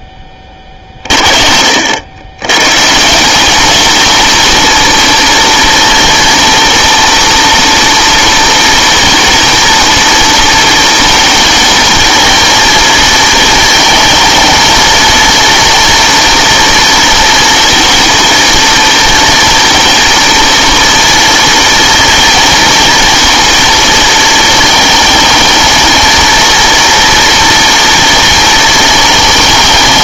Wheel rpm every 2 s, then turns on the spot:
30, 130, 230, 240, 230, 230, 220, 220, 230, 230, 230, 230, 220, 230, 230.
none